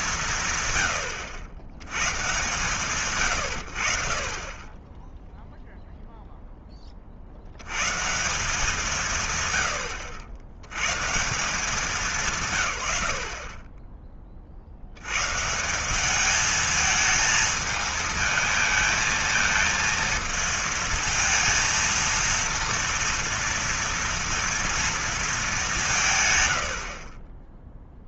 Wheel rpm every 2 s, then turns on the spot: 110, 140, 20, 20, 160, 110, 90, 70, 220, 220, 230, 230, 230, 60.
none